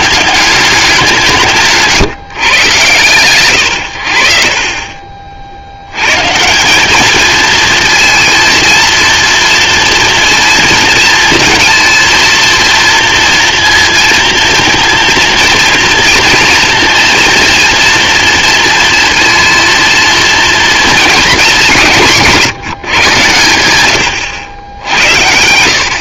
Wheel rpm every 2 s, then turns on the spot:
190, 120, 40, 200, 230, 230, 230, 230, 230, 230, 220, 140, 90.
none